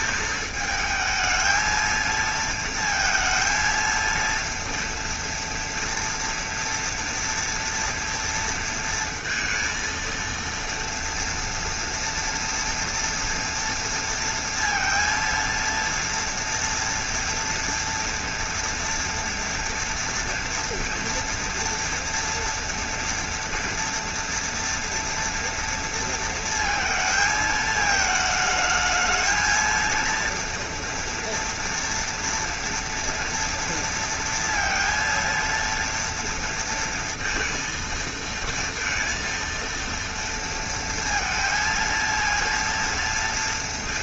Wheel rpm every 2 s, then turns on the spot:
220, 230, 230, 230, 230, 230, 230, 230, 230, 230, 230, 230, 240, 230, 220, 230, 240, 230, 230, 230, 230, 230.
none